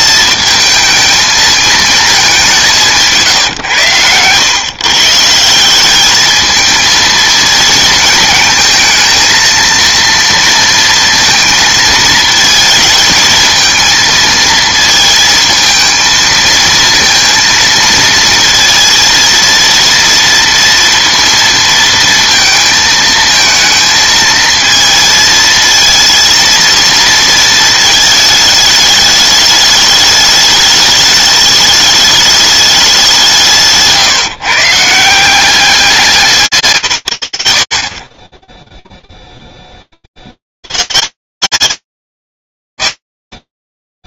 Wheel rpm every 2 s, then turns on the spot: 220, 190, 120, 220, 220, 230, 220, 220, 230, 230, 230, 220, 220, 230, 220, 210, 210, 150, 140, 30, 70, 140.
none